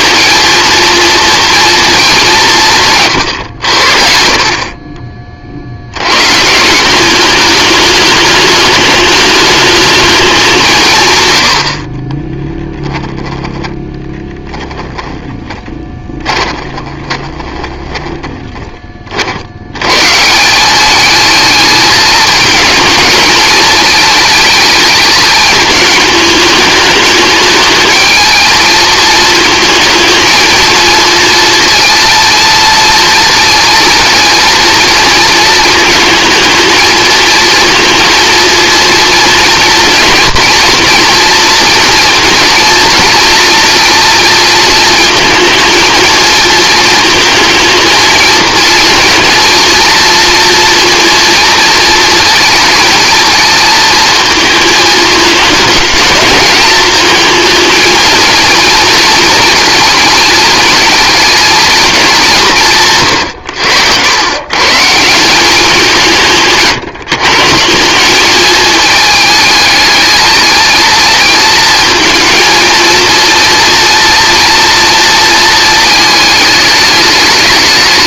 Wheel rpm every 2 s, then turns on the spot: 230, 160, 40, 160, 210, 170, 10, 10, 20, 20, 190, 220, 220, 210, 220, 230, 230, 230, 220, 230, 230, 230, 230, 220, 230, 230, 230, 220, 220, 230, 220, 170, 150, 150, 210, 220, 230, 230, 210.
12-18